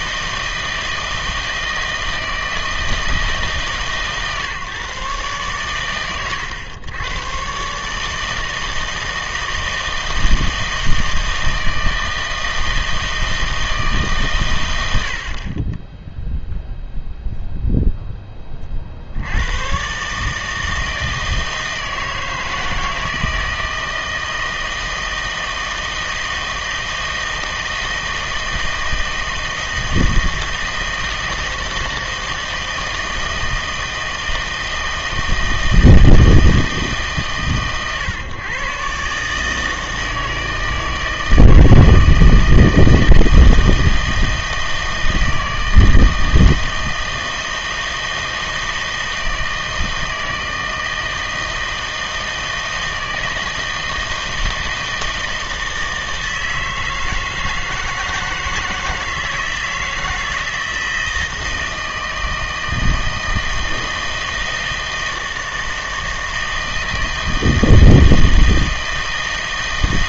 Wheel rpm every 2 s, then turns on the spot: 160, 160, 140, 110, 160, 160, 160, 100, 0, 40, 160, 160, 160, 160, 160, 160, 160, 160, 160, 140, 160, 160, 160, 160, 160, 160, 160, 160, 160, 170, 160, 160, 160, 160, 160.
none